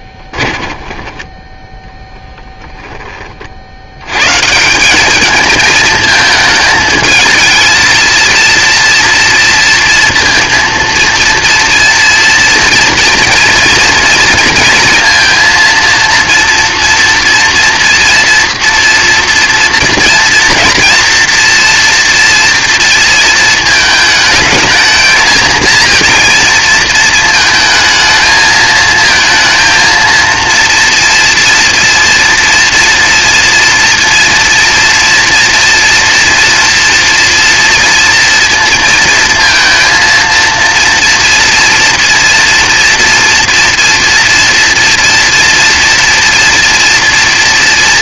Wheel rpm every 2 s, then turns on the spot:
20, 10, 180, 220, 230, 230, 230, 230, 230, 230, 230, 230, 220, 230, 220, 230, 230, 230, 230, 230, 230, 230, 230, 230.
0-2